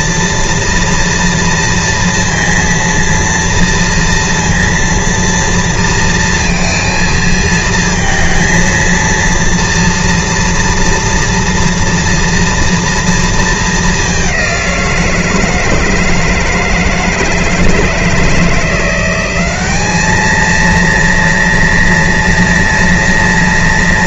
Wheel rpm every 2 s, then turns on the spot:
230, 230, 230, 230, 230, 230, 230, 190, 160, 170, 220, 230.
none